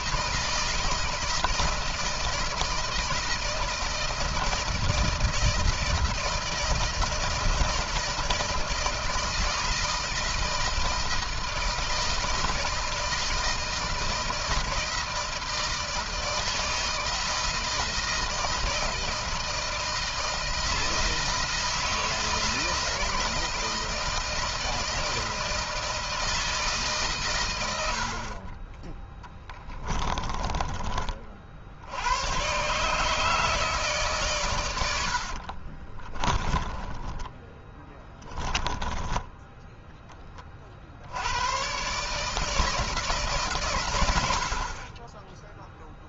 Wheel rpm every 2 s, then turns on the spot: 160, 160, 160, 160, 160, 160, 160, 160, 160, 160, 160, 160, 160, 150, 20, 30, 140, 80, 10, 10, 60, 160, 20.
34-40